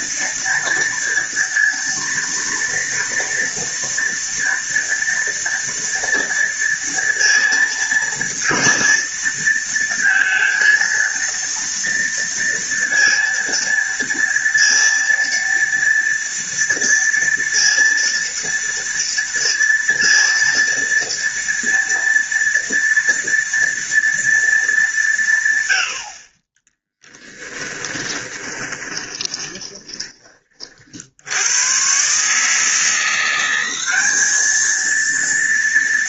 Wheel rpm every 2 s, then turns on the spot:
230, 230, 230, 230, 230, 230, 230, 230, 230, 230, 230, 230, 210, 20, 20, 40, 160, 220.
28-30